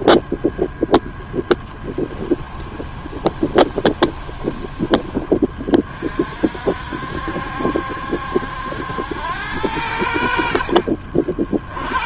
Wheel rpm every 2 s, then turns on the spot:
0, 20, 20, 60, 80, 60.
2-6